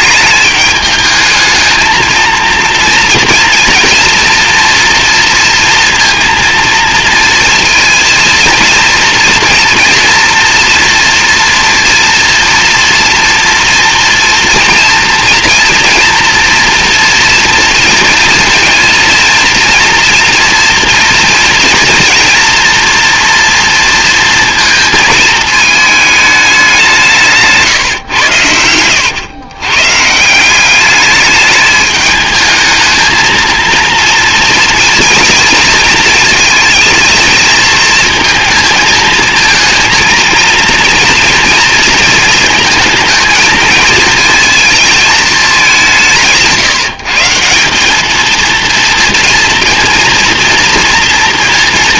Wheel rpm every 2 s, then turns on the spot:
210, 230, 230, 230, 230, 230, 230, 230, 230, 230, 230, 230, 230, 200, 90, 190, 220, 230, 220, 220, 230, 220, 220, 170, 230, 240.
28-30